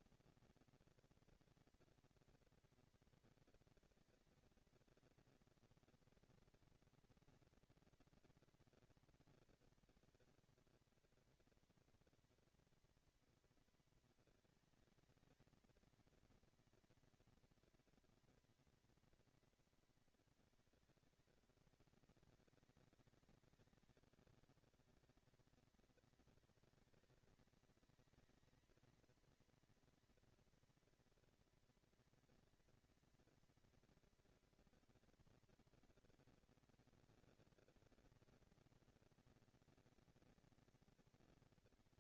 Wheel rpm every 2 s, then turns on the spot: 230, 230, 230, 230, 230, 230, 230, 230, 230, 230, 210, 200, 200, 230, 230, 240, 230, 230, 230, 230, 230.
none